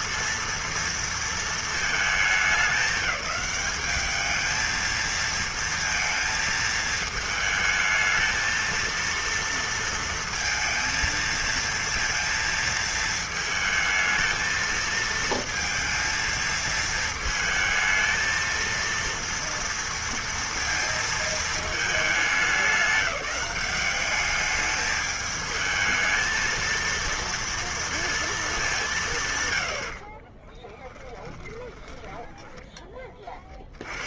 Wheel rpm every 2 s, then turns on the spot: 230, 210, 210, 220, 220, 230, 230, 220, 230, 230, 230, 200, 200, 220, 220, 30, 10.
30-34